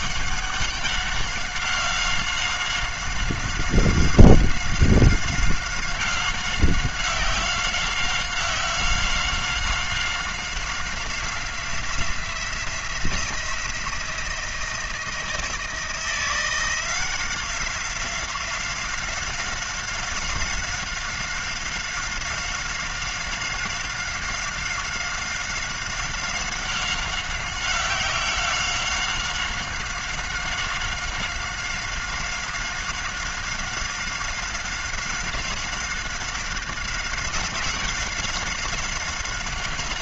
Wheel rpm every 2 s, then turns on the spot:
190, 190, 190, 190, 190, 190, 180, 170, 170, 180, 190, 190, 190, 190, 190, 190, 190, 190, 190, 190.
none